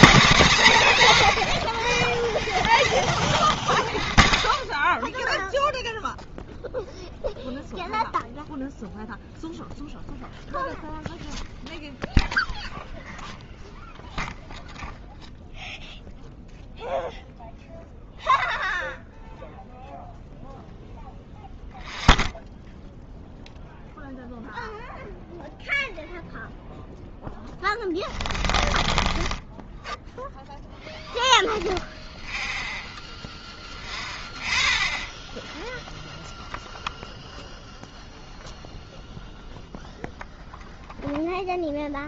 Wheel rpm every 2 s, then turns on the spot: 170, 0, 0, 0, 0, 0, 0, 0, 0, 0, 0, 0, 0, 0, 0, 0, 0, 0, 0, 0, 0.
none